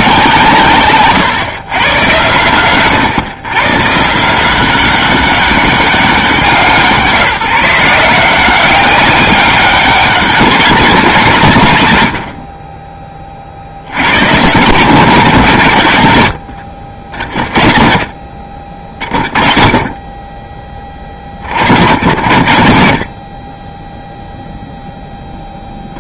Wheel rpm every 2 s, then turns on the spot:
130, 120, 190, 160, 200, 180, 30, 130, 40, 30, 30, 50, 0.
0-2